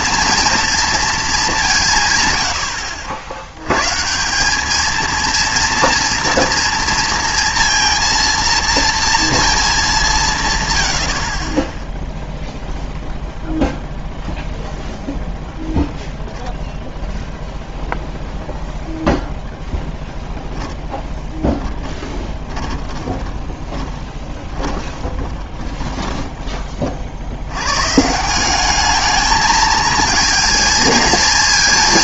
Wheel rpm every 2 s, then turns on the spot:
230, 90, 210, 230, 230, 120, 0, 0, 0, 0, 0, 10, 20, 30, 190, 230.
22-26